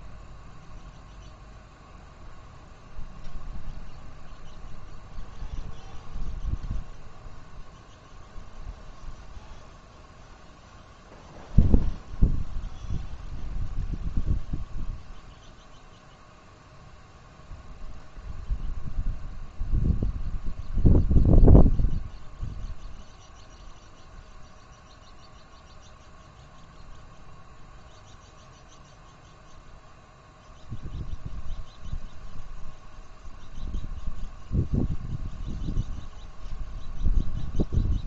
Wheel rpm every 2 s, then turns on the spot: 0, 0, 0, 0, 0, 0, 0, 0, 0, 0, 0, 0, 0, 0, 0, 0, 0, 0, 0.
none